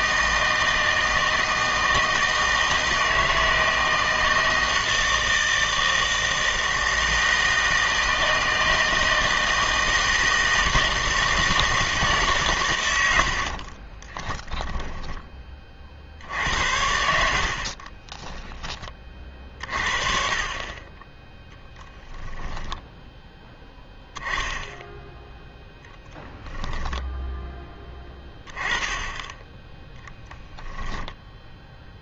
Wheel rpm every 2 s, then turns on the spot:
160, 160, 160, 160, 160, 160, 100, 10, 80, 10, 30, 0, 10, 10, 10, 0.
14-16 26-28